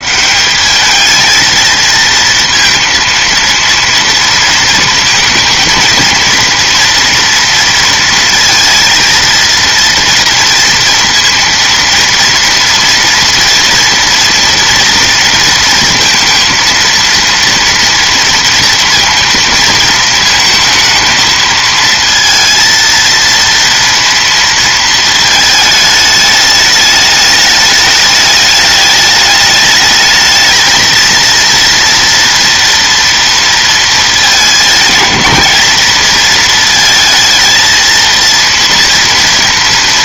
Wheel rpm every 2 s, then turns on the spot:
190, 230, 230, 230, 230, 230, 230, 240, 230, 230, 220, 230, 230, 210, 210, 220, 230, 210, 220, 230.
none